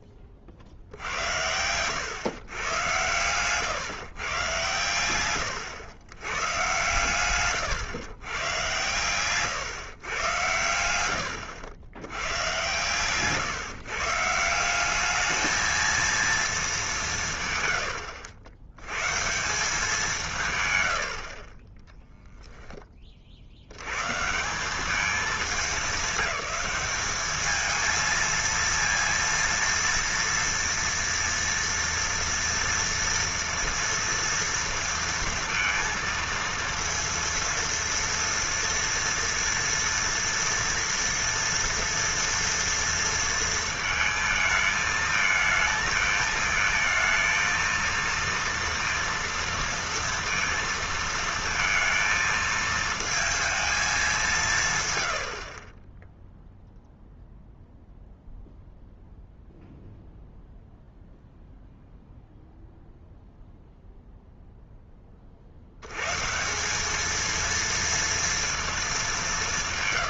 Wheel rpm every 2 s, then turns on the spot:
50, 110, 120, 110, 120, 90, 120, 180, 220, 90, 130, 10, 190, 210, 230, 230, 230, 230, 230, 230, 240, 230, 220, 220, 230, 230, 220, 190, 0, 0, 0, 0, 0, 180, 230.
none